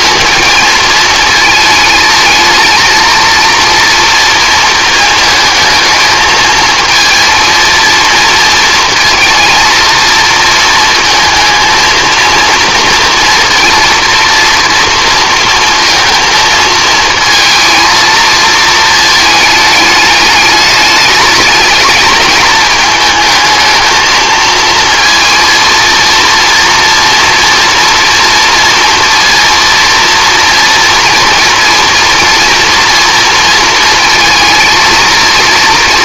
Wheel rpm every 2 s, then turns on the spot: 220, 230, 220, 220, 230, 220, 230, 230, 220, 220, 210, 220, 230, 230, 230, 230, 230, 230.
none